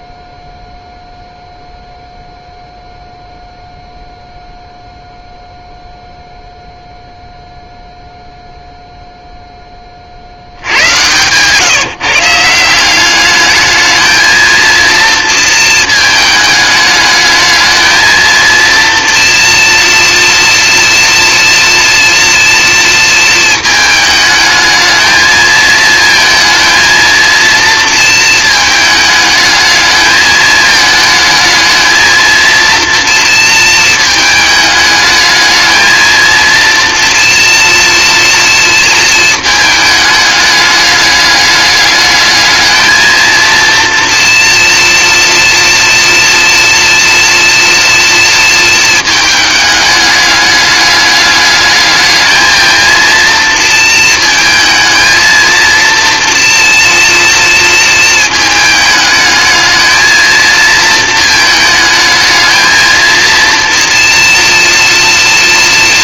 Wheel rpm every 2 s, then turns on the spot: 0, 0, 0, 0, 0, 70, 170, 220, 220, 230, 230, 230, 210, 230, 220, 220, 230, 220, 230, 240, 210, 210, 230, 230, 230, 210, 220, 230, 230, 220, 230, 220, 240.
none